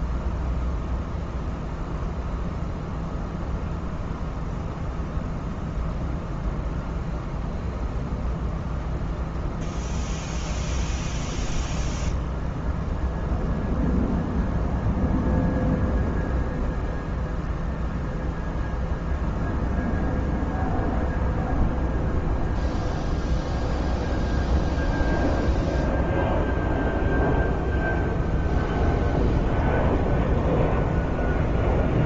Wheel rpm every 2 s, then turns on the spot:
0, 0, 0, 0, 0, 0, 0, 0, 0, 0, 0, 0, 0, 0, 0, 0.
none